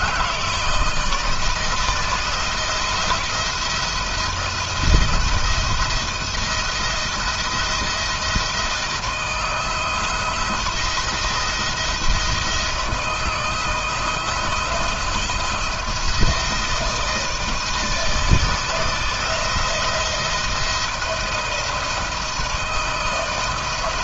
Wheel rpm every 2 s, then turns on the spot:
160, 170, 170, 170, 160, 170, 160, 160, 160, 160, 170, 160.
none